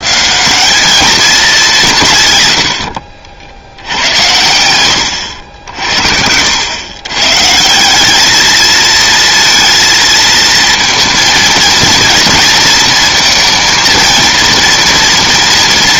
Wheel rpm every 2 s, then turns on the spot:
210, 80, 100, 110, 220, 230, 230, 230.
none